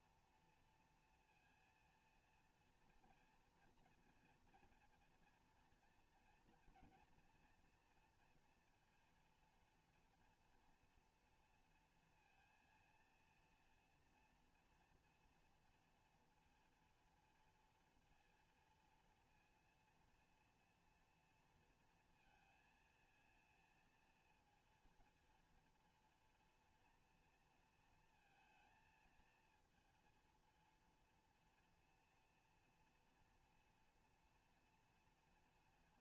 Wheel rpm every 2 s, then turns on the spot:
230, 230, 230, 230, 230, 240, 230, 240, 230, 230, 230, 230, 230, 230, 220, 230, 230, 230.
none